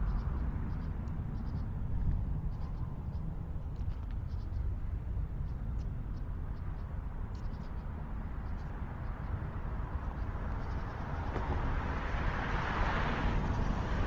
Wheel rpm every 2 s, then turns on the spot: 0, 0, 0, 0, 0, 0, 0.
none